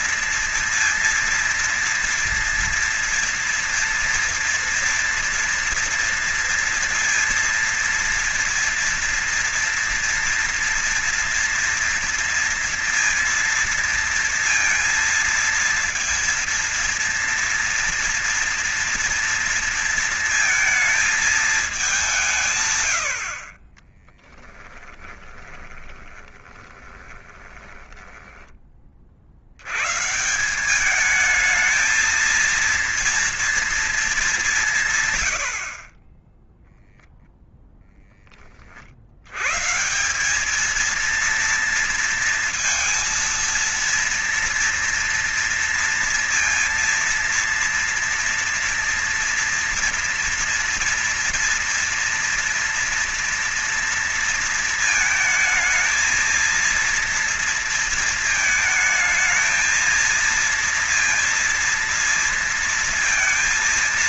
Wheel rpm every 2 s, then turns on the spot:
230, 230, 230, 230, 240, 230, 230, 230, 230, 230, 230, 90, 20, 20, 50, 210, 230, 130, 0, 70, 230, 230, 230, 230, 230, 230, 230, 230, 230, 220, 230, 230.
24-28